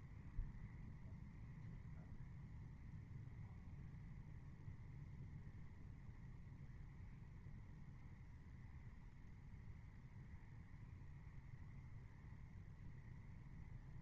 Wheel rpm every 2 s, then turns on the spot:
0, 0, 0, 0, 0, 0, 0.
none